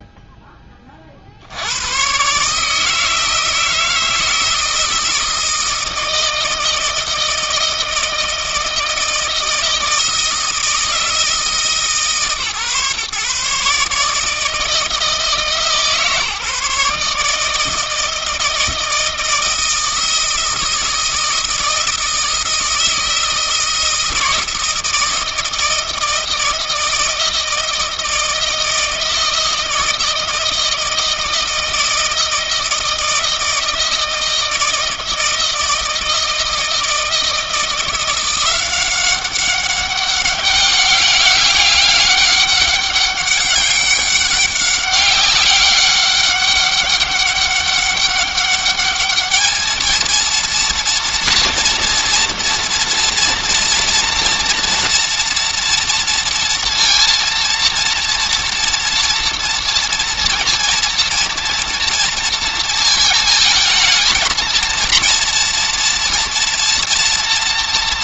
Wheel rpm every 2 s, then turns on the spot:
30, 160, 160, 160, 160, 160, 140, 160, 150, 160, 160, 160, 160, 160, 160, 160, 160, 160, 160, 180, 200, 200, 200, 200, 210, 230, 230, 230, 230, 230, 230, 220, 230, 230.
none